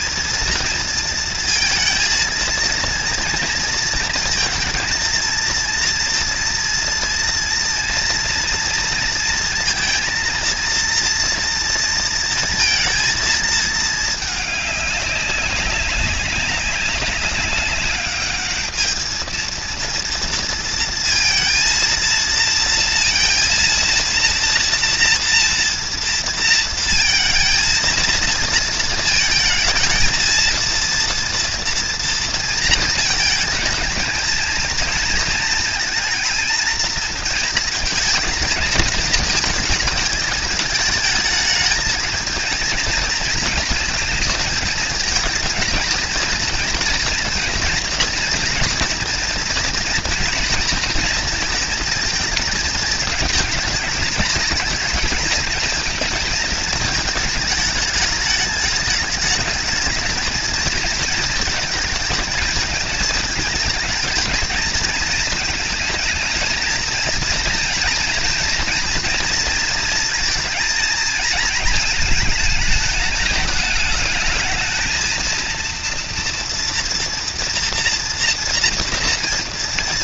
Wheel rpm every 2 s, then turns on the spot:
230, 230, 230, 230, 230, 230, 230, 200, 190, 210, 230, 230, 230, 230, 230, 230, 230, 230, 230, 220, 210, 230, 220, 230, 240, 230, 220, 220, 220, 210, 230, 220, 220, 230, 230, 220, 220, 230, 230, 230.
none